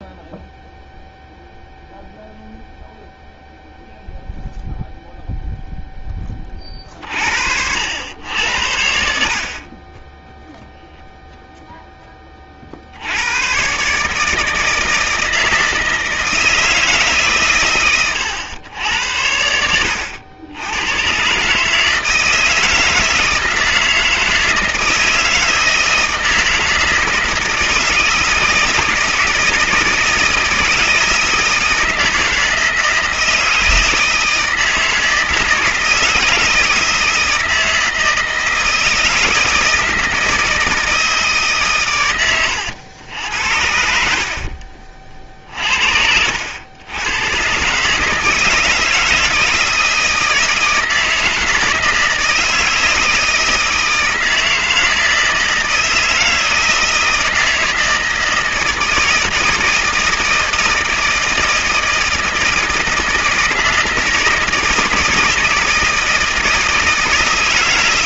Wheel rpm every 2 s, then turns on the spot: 0, 0, 0, 50, 70, 0, 80, 160, 150, 90, 110, 160, 160, 160, 160, 160, 160, 160, 160, 160, 160, 90, 50, 100, 160, 160, 160, 160, 160, 160, 160, 160, 160, 160.
none